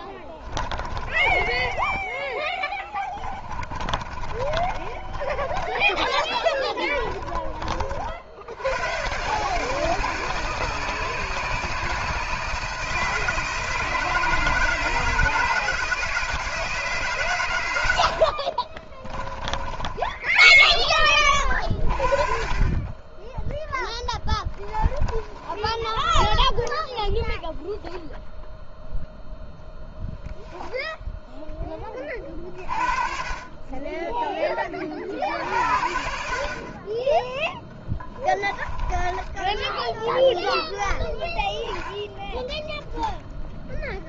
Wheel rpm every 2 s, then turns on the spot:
40, 20, 30, 20, 60, 160, 160, 160, 160, 70, 10, 40, 10, 0, 0, 0, 40, 10, 60, 20, 0, 10.
0-2 4-8 18-22 24-26 38-40